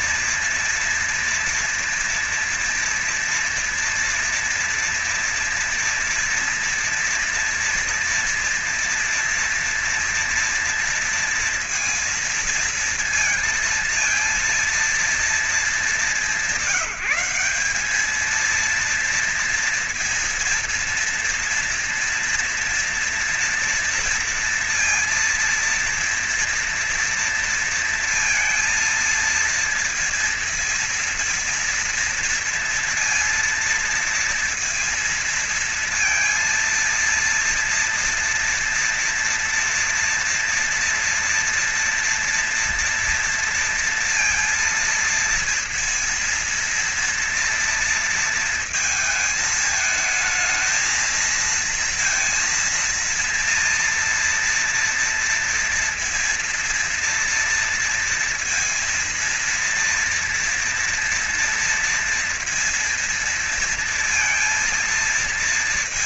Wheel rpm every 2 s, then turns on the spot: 230, 230, 230, 240, 230, 230, 230, 230, 180, 230, 230, 230, 230, 230, 230, 230, 230, 230, 230, 230, 230, 230, 230, 230, 230, 220, 230, 230, 230, 230, 230, 230, 230.
none